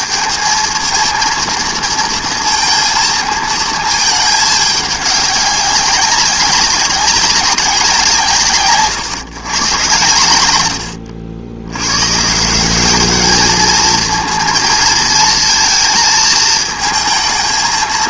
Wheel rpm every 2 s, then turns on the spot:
220, 230, 220, 190, 160, 120, 140, 230, 220.
none